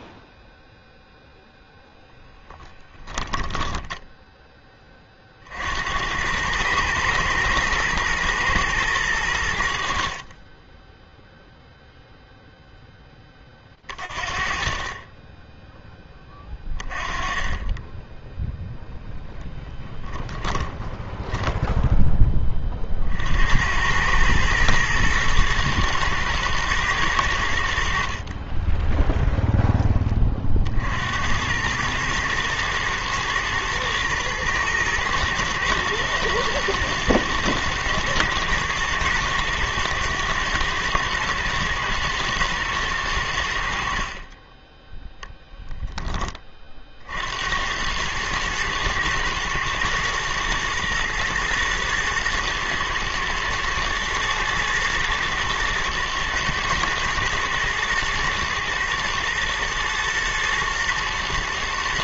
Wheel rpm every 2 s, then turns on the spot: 0, 10, 60, 120, 90, 0, 50, 10, 20, 10, 10, 90, 120, 80, 10, 100, 110, 110, 110, 110, 110, 70, 10, 80, 110, 120, 110, 110, 120, 120, 120.
18-20 44-46